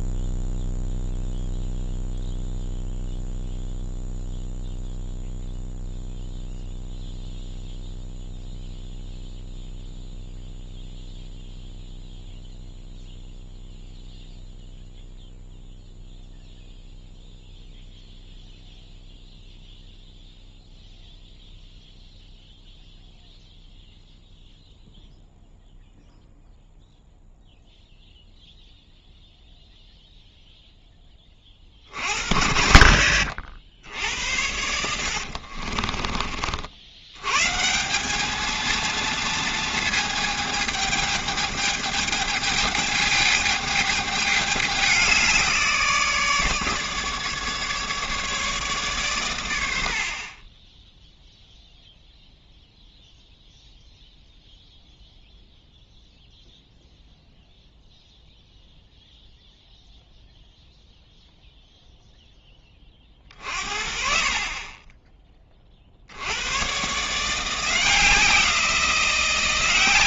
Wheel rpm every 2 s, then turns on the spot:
0, 0, 0, 0, 0, 0, 0, 0, 0, 0, 0, 0, 0, 0, 0, 0, 80, 80, 60, 220, 220, 210, 200, 150, 150, 20, 0, 0, 0, 0, 0, 20, 30, 120, 170.
34-36